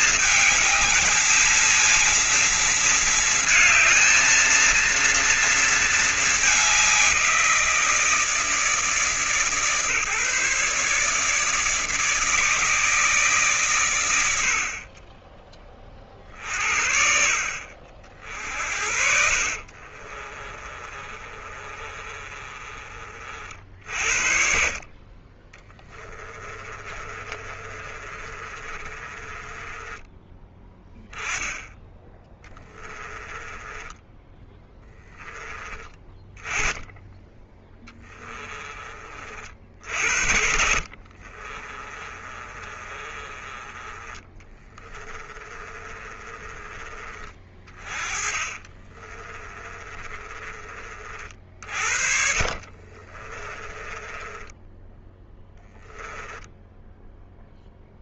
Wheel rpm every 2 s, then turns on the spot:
220, 230, 230, 170, 150, 150, 140, 30, 50, 40, 30, 40, 40, 30, 30, 10, 10, 10, 20, 30, 60, 30, 20, 30, 20, 40, 40, 10, 0.
18-22 26-30 32-34 40-46 48-50 52-56